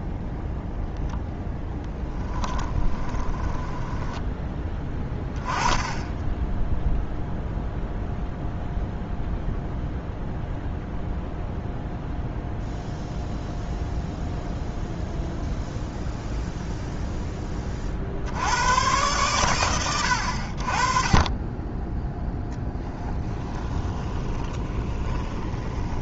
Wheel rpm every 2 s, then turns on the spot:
0, 10, 10, 0, 0, 0, 0, 0, 0, 100, 40, 10, 20.
2-4 22-26